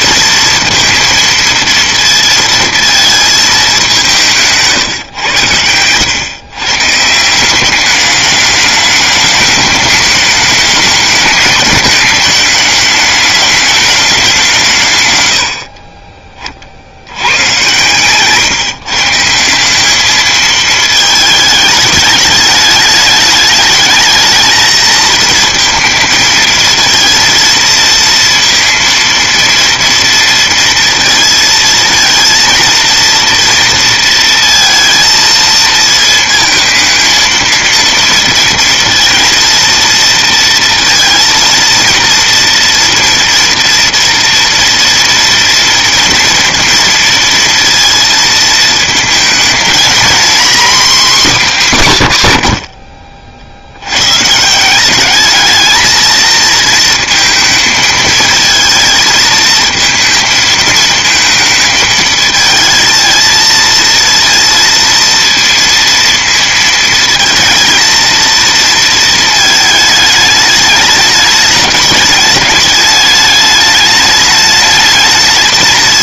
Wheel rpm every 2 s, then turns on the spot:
230, 230, 150, 130, 210, 210, 220, 160, 40, 150, 220, 210, 220, 220, 230, 230, 230, 230, 220, 230, 230, 230, 230, 230, 220, 240, 80, 170, 230, 220, 220, 220, 230, 230, 230, 210, 210, 210.
none